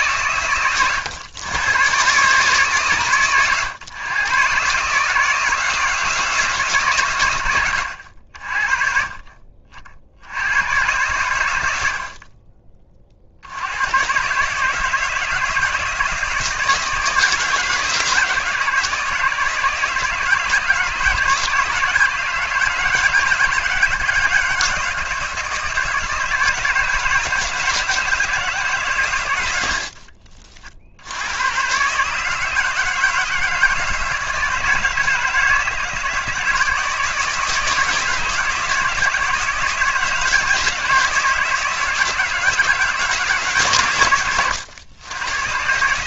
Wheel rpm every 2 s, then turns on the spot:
110, 130, 160, 130, 40, 110, 40, 160, 160, 150, 160, 160, 160, 160, 140, 70, 160, 160, 160, 160, 160, 160, 110.
none